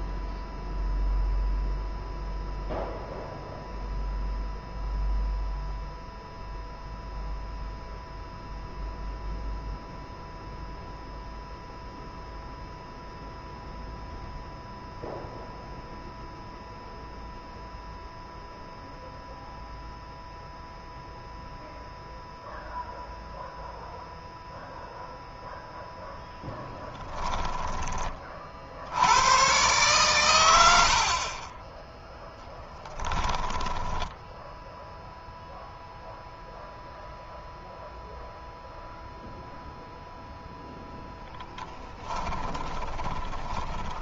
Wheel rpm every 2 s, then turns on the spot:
0, 0, 0, 0, 0, 0, 0, 0, 0, 0, 0, 0, 0, 10, 60, 90, 10, 0, 0, 0, 0, 10.
26-28 30-34 42-44